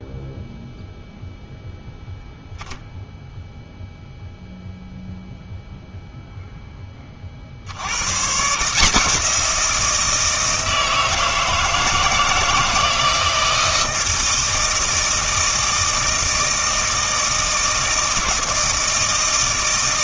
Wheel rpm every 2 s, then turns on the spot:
0, 0, 0, 10, 150, 160, 160, 160, 160, 160.
none